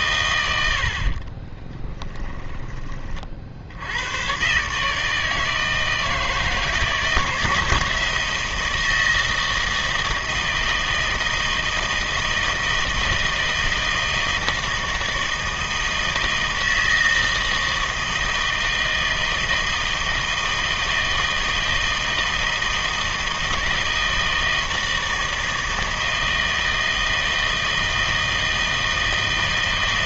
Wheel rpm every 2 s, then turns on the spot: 80, 20, 140, 160, 160, 160, 160, 160, 160, 160, 160, 160, 160, 160, 160.
none